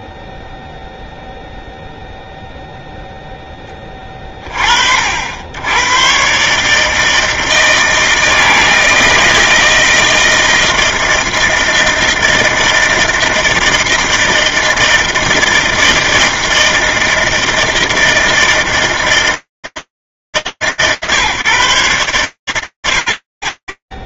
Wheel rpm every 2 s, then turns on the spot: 0, 0, 0, 60, 160, 160, 160, 160, 160, 160, 150, 110.
none